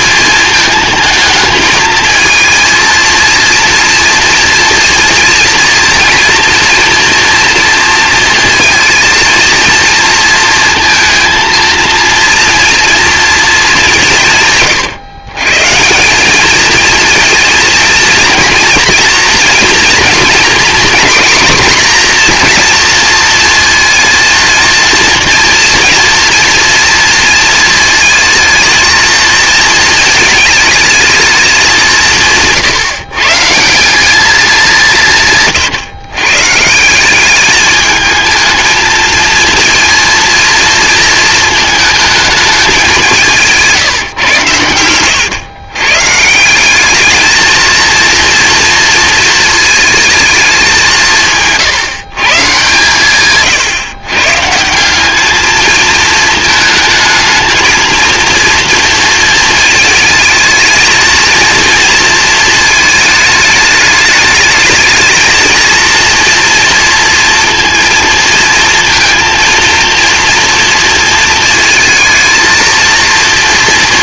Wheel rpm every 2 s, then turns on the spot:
220, 220, 230, 230, 230, 230, 230, 140, 220, 230, 240, 240, 230, 230, 220, 220, 160, 200, 140, 220, 230, 220, 120, 190, 230, 200, 140, 150, 220, 230, 220, 220, 220, 230, 230, 230, 230.
none